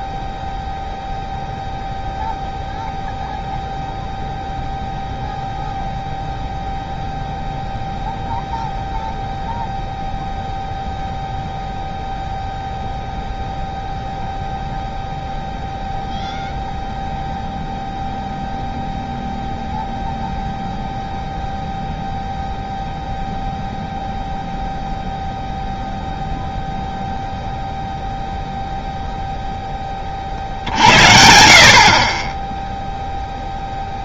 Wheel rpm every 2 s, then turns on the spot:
0, 0, 0, 0, 0, 0, 0, 0, 0, 0, 0, 0, 0, 0, 0, 60, 0.
none